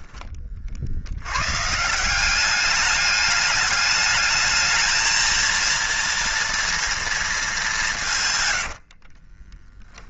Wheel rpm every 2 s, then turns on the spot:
50, 200, 220, 230, 90.
8-10